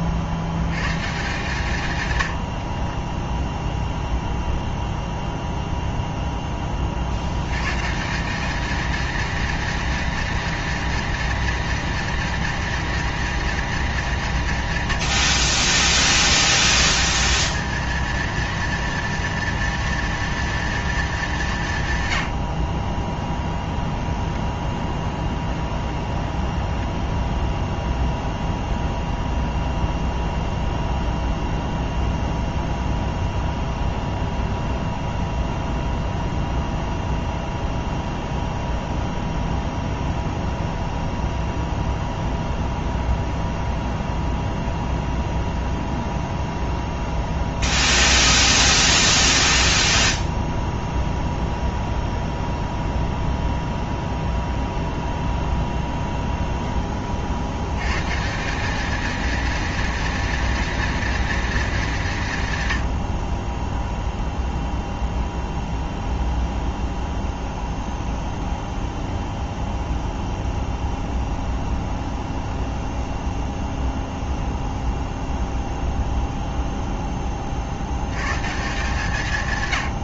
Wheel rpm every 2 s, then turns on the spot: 70, 70, 0, 10, 210, 230, 230, 140, 70, 230, 230, 70, 10, 10, 0, 0, 0, 0, 0, 0, 0, 0, 0, 0, 0, 0, 0, 0, 0, 190, 230, 140, 0, 0, 0, 0, 0, 0, 0, 140.
2-4 22-28